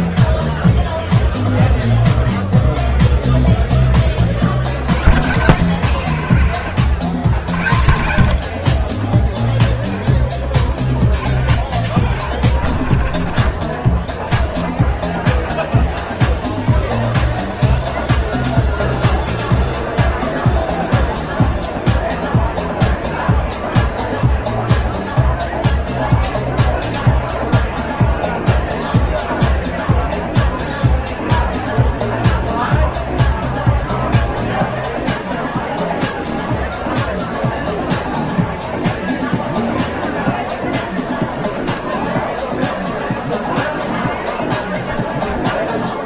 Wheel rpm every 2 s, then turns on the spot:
0, 0, 40, 80, 40, 10, 50, 0, 0, 0, 0, 0, 0, 0, 0, 0, 0, 0, 0, 0, 0, 0, 10.
none